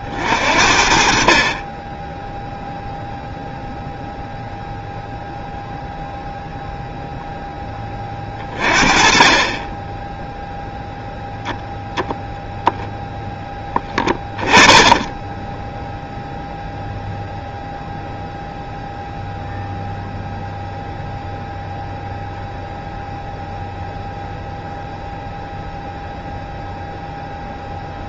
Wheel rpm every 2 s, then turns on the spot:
40, 0, 0, 0, 30, 0, 0, 10, 0, 0, 0, 0, 0, 0.
8-10 14-16